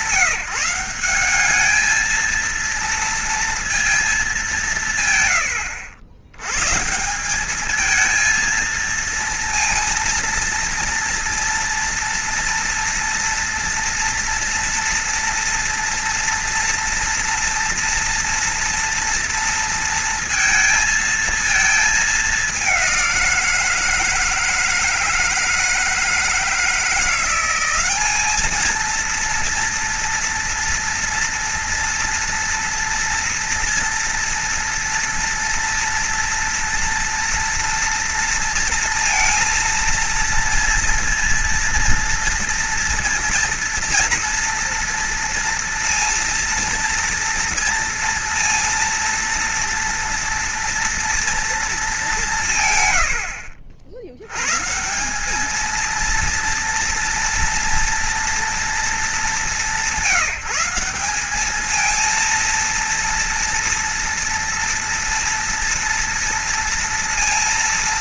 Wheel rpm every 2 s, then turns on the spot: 180, 230, 140, 170, 230, 230, 230, 230, 230, 230, 220, 190, 160, 170, 220, 240, 230, 230, 230, 230, 230, 230, 230, 230, 230, 230, 110, 170, 230, 200, 190, 230, 230, 230.
none